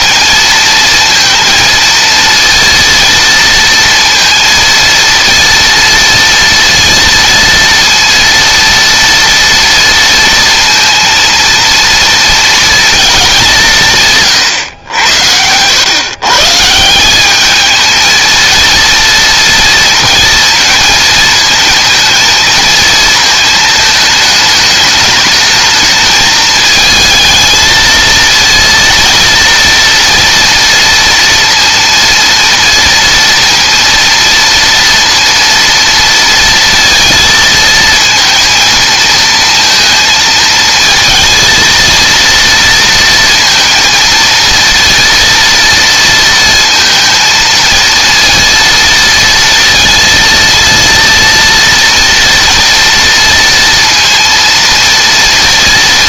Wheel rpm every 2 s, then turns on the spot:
230, 230, 230, 230, 230, 230, 230, 120, 150, 230, 220, 230, 220, 220, 230, 230, 230, 230, 230, 230, 220, 230, 230, 230, 230, 230, 230, 230.
none